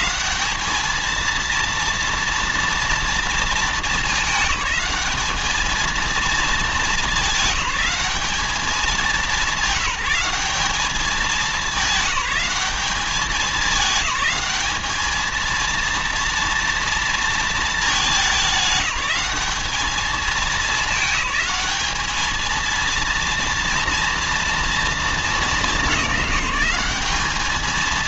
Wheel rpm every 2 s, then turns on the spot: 220, 220, 210, 210, 200, 200, 210, 220, 230, 190, 200, 230, 220, 210.
none